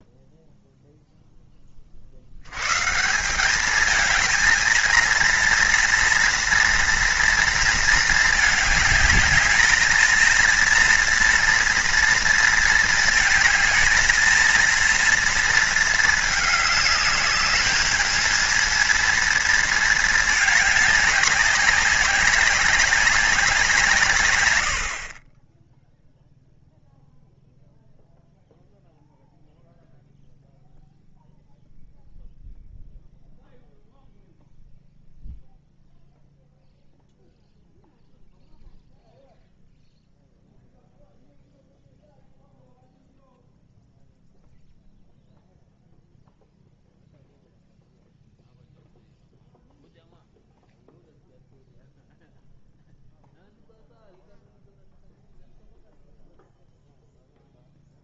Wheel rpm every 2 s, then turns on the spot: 0, 100, 220, 230, 210, 230, 230, 230, 210, 230, 210, 200, 90, 0, 0, 0, 0, 0, 0, 0, 0, 0, 0, 0, 0, 0, 0, 0, 0.
none